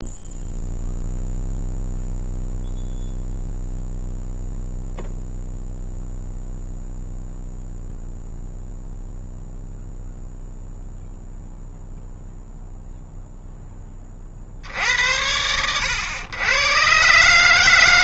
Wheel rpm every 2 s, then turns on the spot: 0, 0, 0, 0, 0, 0, 0, 70, 110.
none